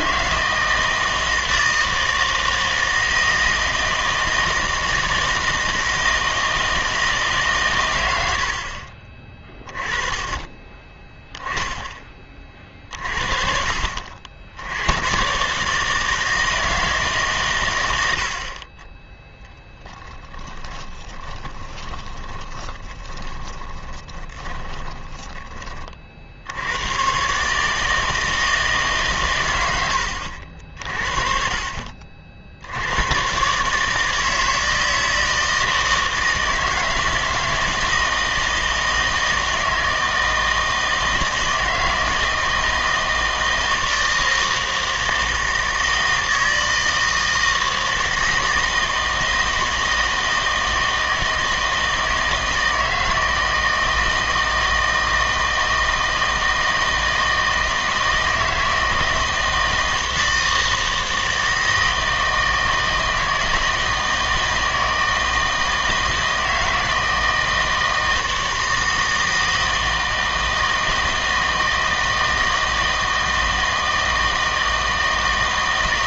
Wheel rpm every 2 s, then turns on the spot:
160, 160, 160, 160, 50, 20, 40, 70, 160, 40, 20, 20, 20, 90, 150, 60, 70, 160, 160, 160, 160, 160, 160, 160, 160, 160, 160, 160, 160, 160, 160, 160, 160, 160, 160, 160, 160, 160.
20-26